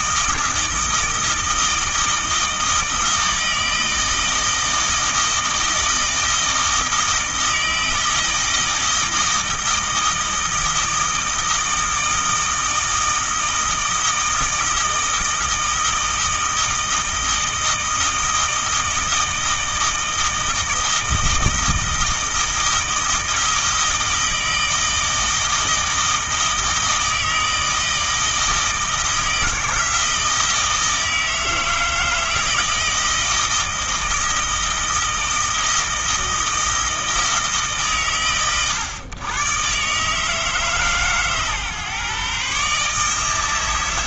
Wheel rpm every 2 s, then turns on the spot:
160, 160, 160, 160, 160, 160, 160, 160, 160, 160, 160, 160, 160, 160, 160, 160, 160, 160, 160, 110, 150, 150.
none